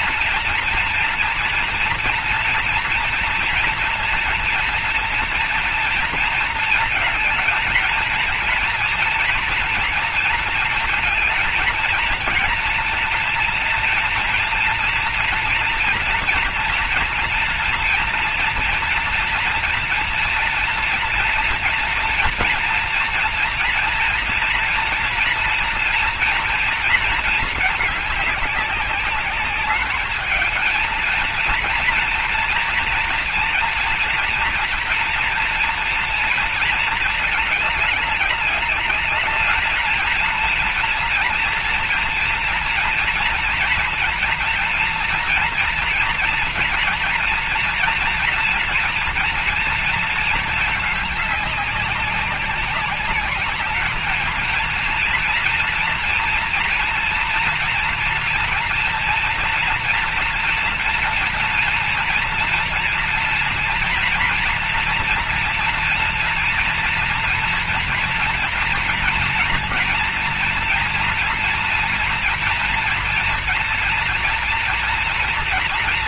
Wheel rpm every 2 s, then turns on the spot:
230, 230, 230, 230, 230, 220, 230, 230, 230, 230, 230, 230, 230, 240, 200, 220, 240, 230, 230, 210, 230, 240, 230, 240, 240, 220, 190, 230, 240, 230, 240, 230, 230, 230, 240, 240, 230, 230.
none